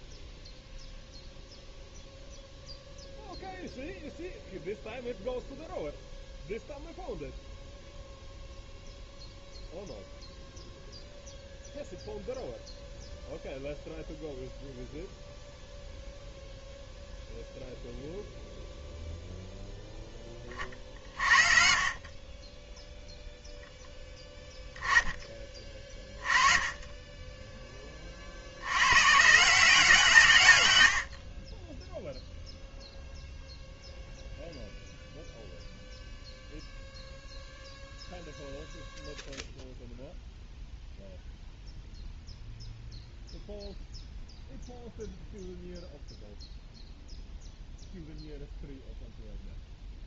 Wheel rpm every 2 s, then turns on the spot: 0, 0, 0, 0, 0, 0, 0, 0, 0, 0, 40, 0, 10, 10, 120, 80, 0, 0, 0, 0, 0, 0, 0, 0, 0.
none